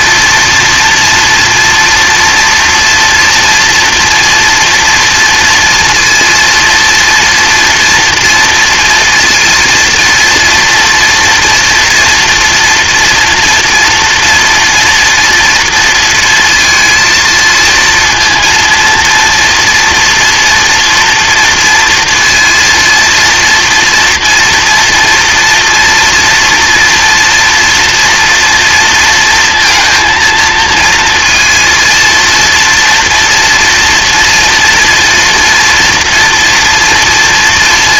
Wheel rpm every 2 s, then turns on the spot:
230, 230, 230, 230, 230, 230, 230, 240, 230, 230, 230, 230, 230, 240, 230, 230, 230, 240, 230.
none